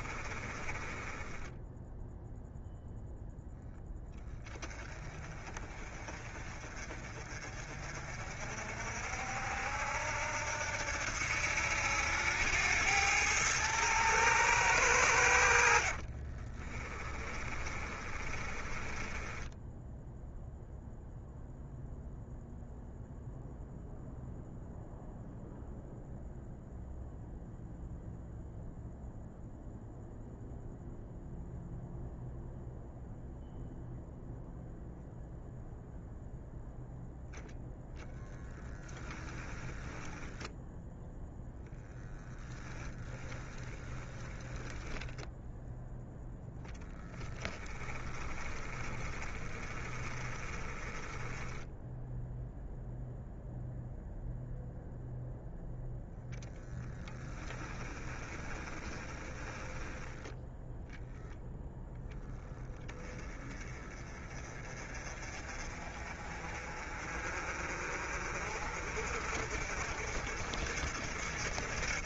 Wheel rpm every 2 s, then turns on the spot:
20, 0, 20, 40, 60, 80, 100, 100, 20, 20, 0, 0, 0, 0, 0, 0, 0, 0, 0, 10, 0, 30, 10, 10, 20, 10, 0, 0, 10, 20, 0, 10, 30, 40, 50, 60.
0-2 16-20 38-40 42-44 46-52 56-60